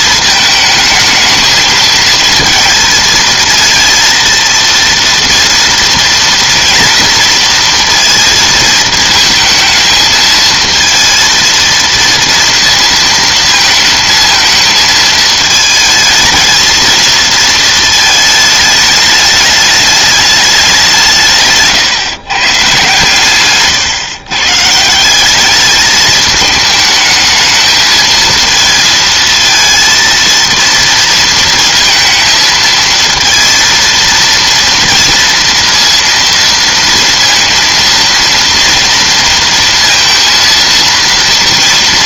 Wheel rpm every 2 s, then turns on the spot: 220, 220, 230, 230, 230, 220, 230, 220, 220, 210, 200, 140, 130, 210, 220, 230, 230, 230, 230, 230, 230.
none